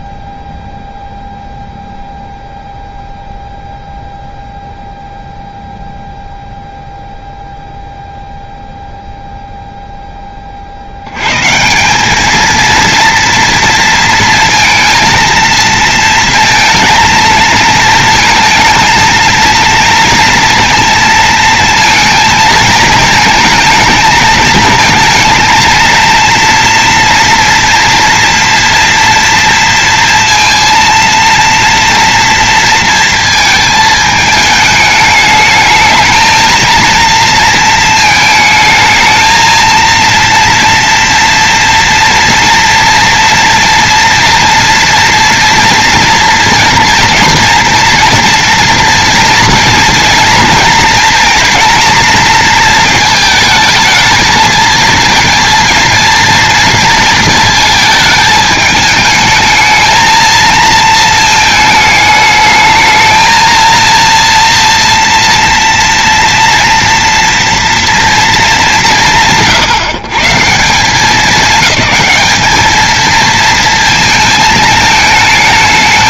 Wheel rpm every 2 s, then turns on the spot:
0, 0, 0, 0, 0, 40, 230, 230, 230, 230, 230, 220, 220, 230, 230, 230, 230, 220, 220, 220, 240, 230, 230, 240, 230, 230, 230, 220, 230, 210, 220, 220, 230, 240, 160, 170, 210, 220.
none